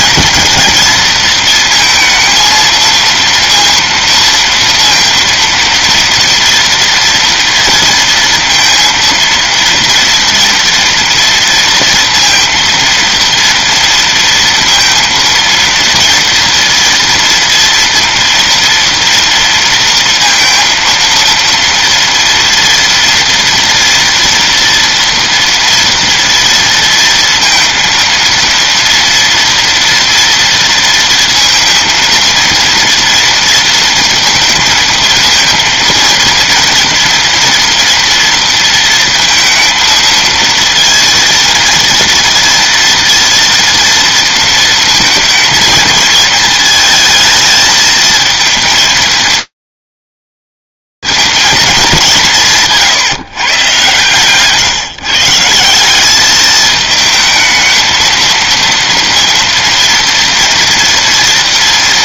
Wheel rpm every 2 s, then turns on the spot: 230, 230, 230, 230, 230, 230, 230, 230, 230, 230, 230, 230, 230, 230, 230, 230, 230, 230, 230, 230, 230, 230, 230, 220, 220, 180, 130, 200, 220, 230, 230.
none